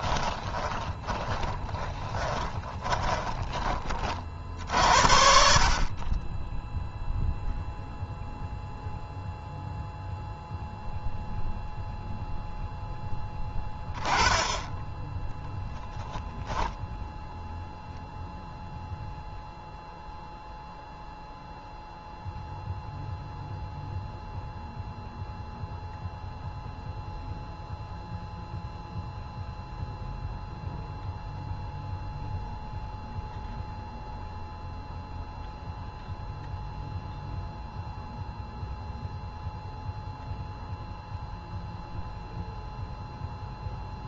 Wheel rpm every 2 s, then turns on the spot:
10, 20, 70, 10, 0, 0, 10, 10, 0, 0, 0, 0, 0, 0, 0, 0, 0, 0, 0, 0, 0, 0.
0-4